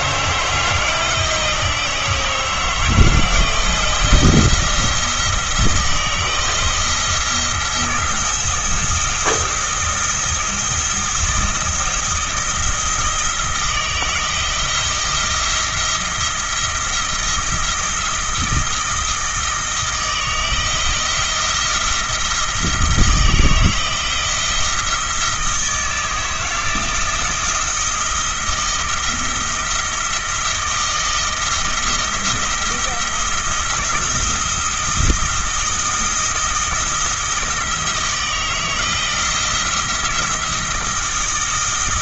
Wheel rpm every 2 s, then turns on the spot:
160, 160, 170, 170, 170, 170, 170, 160, 170, 160, 160, 160, 170, 160, 170, 170, 170, 170, 170, 160, 160.
none